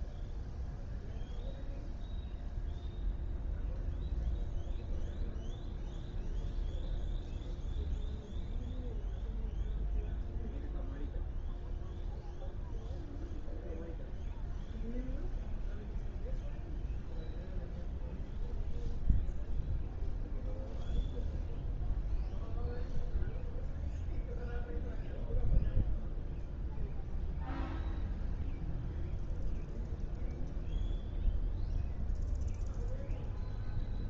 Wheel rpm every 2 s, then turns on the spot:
0, 0, 0, 0, 0, 0, 0, 0, 0, 0, 0, 0, 0, 0, 0, 0, 0.
none